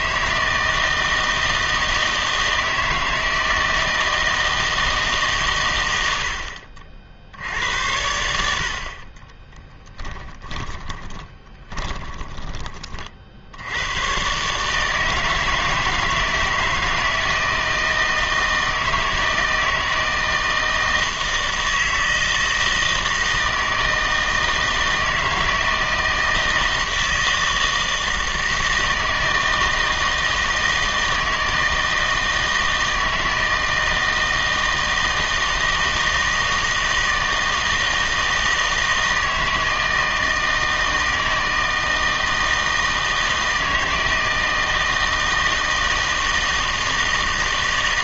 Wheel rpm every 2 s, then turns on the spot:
160, 160, 160, 60, 70, 20, 30, 150, 160, 160, 160, 160, 160, 160, 160, 160, 160, 160, 160, 160, 160, 160, 160, 160.
10-12